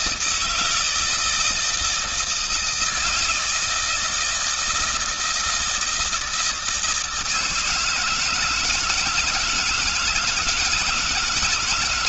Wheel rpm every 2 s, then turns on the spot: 160, 160, 160, 160, 170, 170.
none